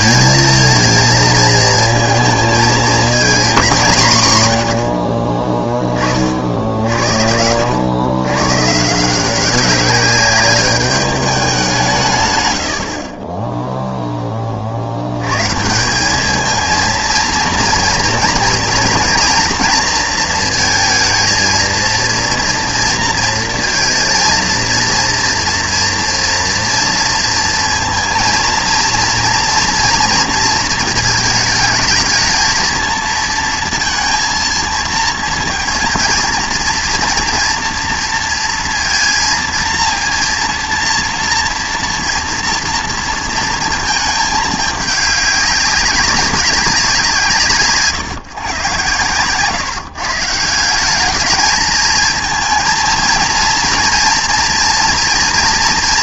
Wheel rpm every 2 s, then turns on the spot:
230, 230, 90, 60, 140, 200, 60, 60, 220, 230, 230, 230, 230, 230, 230, 220, 230, 230, 230, 230, 230, 230, 210, 190, 120, 190, 230, 240.
none